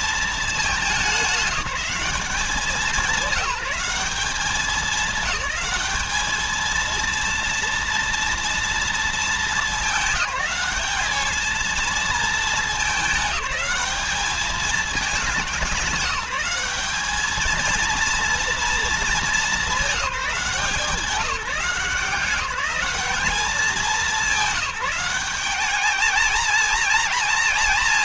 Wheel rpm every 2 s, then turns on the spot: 200, 190, 210, 220, 230, 210, 210, 210, 210, 230, 170, 200, 190, 230.
none